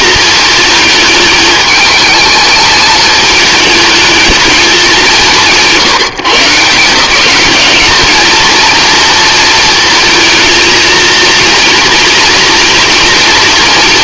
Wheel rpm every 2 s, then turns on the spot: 220, 220, 200, 160, 230, 230, 230.
none